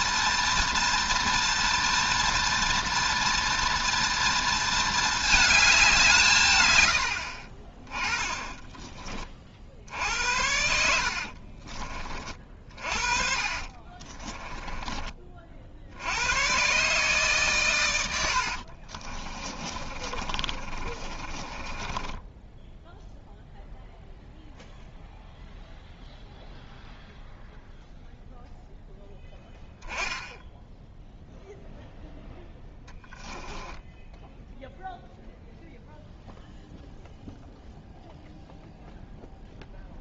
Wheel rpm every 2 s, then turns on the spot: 230, 230, 220, 90, 20, 60, 40, 20, 140, 40, 30, 0, 0, 0, 0, 0, 10, 0, 0, 0.
10-14 18-22 32-34